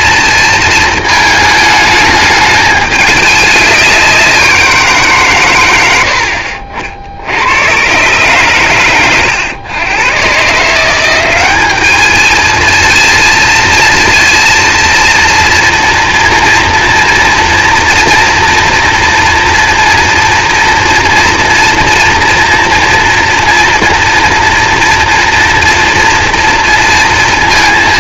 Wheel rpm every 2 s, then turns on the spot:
220, 210, 160, 60, 110, 170, 230, 230, 230, 240, 230, 230, 230, 230.
none